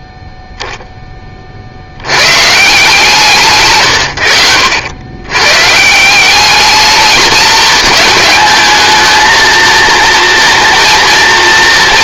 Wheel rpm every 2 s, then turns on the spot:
0, 170, 90, 210, 220, 230.
none